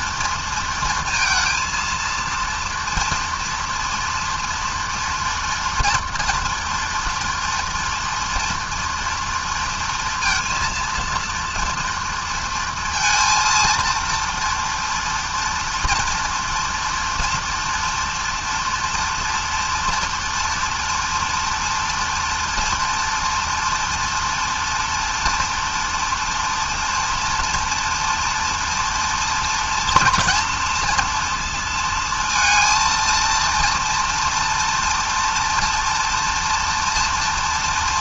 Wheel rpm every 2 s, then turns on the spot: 230, 230, 230, 230, 230, 230, 230, 240, 230, 230, 240, 240, 230, 230, 230, 230, 230, 240, 230.
none